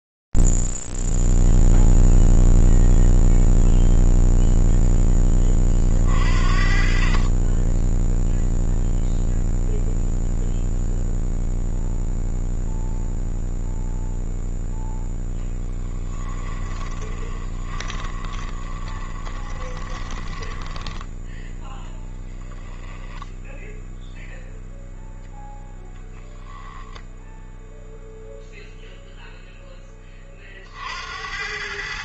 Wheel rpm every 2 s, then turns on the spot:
0, 0, 0, 40, 10, 0, 0, 0, 20, 20, 10, 10, 0, 0, 0, 40.
16-24